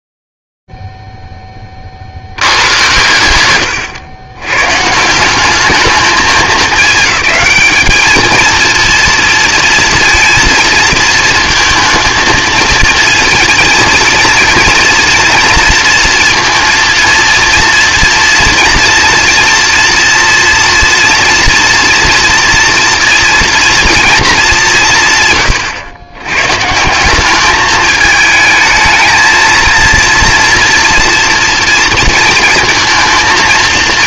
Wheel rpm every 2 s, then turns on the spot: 0, 70, 110, 220, 220, 230, 220, 230, 230, 230, 240, 230, 230, 110, 220, 230, 230.
none